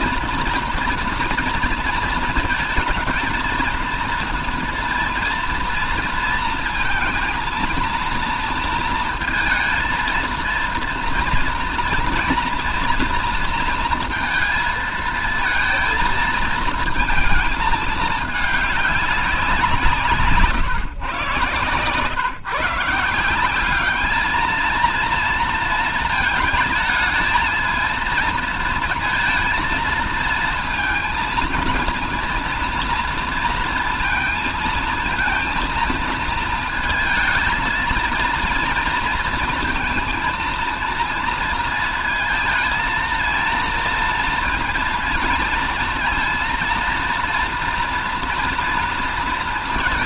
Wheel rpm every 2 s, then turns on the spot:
230, 230, 230, 230, 230, 230, 230, 230, 230, 210, 150, 150, 220, 220, 230, 230, 230, 230, 220, 230, 230, 220, 230, 230, 230.
20-22